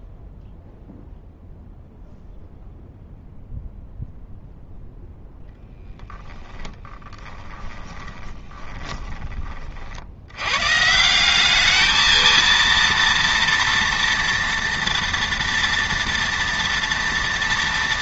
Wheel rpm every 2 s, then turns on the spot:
0, 0, 0, 10, 20, 130, 230, 230, 230.
6-10